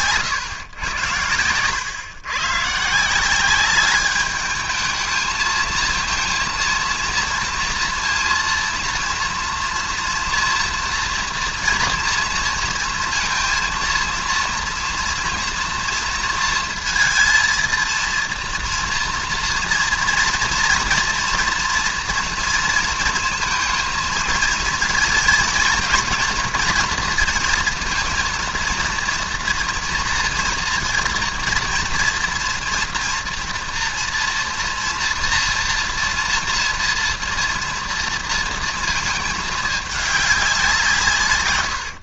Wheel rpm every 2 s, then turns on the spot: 130, 130, 210, 230, 230, 230, 230, 230, 230, 230, 230, 230, 230, 240, 230, 230, 230, 240, 240, 230, 190.
none